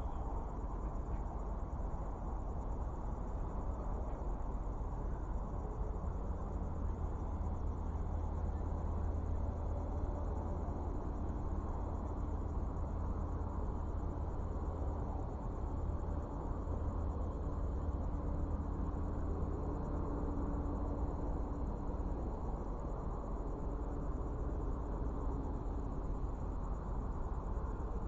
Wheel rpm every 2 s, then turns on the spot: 0, 0, 0, 0, 0, 0, 0, 0, 0, 0, 0, 0, 0, 0.
none